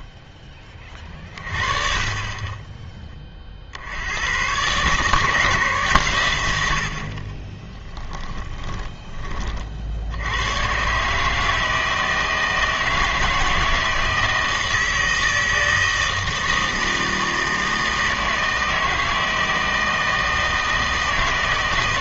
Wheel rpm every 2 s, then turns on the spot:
30, 10, 140, 80, 20, 130, 160, 160, 160, 160, 160.
8-10